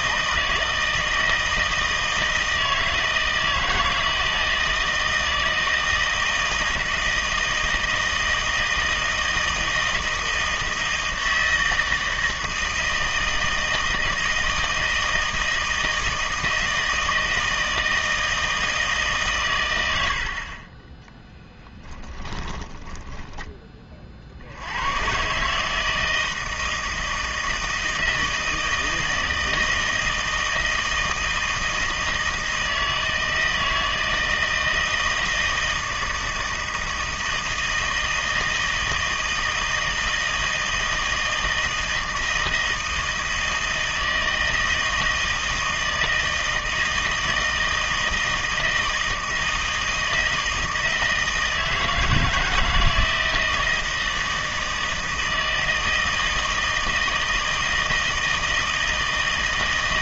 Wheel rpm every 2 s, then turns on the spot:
160, 160, 160, 160, 160, 160, 160, 160, 160, 160, 50, 20, 60, 160, 160, 160, 160, 160, 160, 160, 160, 160, 160, 160, 160, 160, 160, 160, 160, 160.
20-24